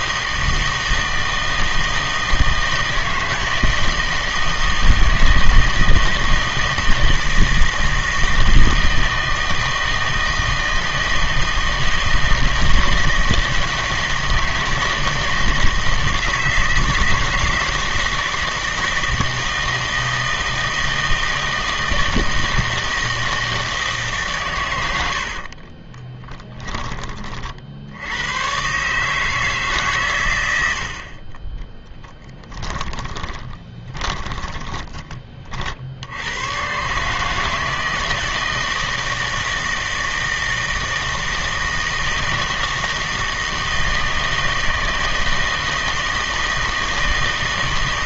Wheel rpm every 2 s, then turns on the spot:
160, 160, 160, 160, 160, 160, 160, 170, 160, 160, 160, 160, 110, 10, 120, 90, 10, 30, 130, 160, 160, 160, 160, 160.
32-36